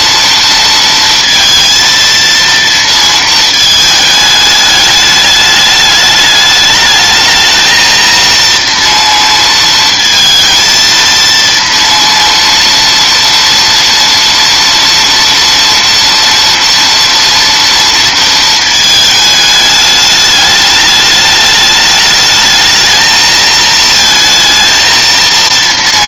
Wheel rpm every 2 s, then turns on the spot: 230, 230, 210, 210, 230, 230, 230, 230, 230, 220, 210, 220, 230.
none